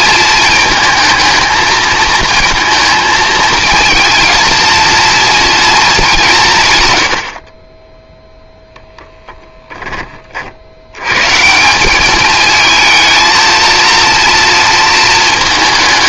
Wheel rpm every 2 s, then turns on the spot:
220, 230, 230, 120, 0, 90, 220, 230.
none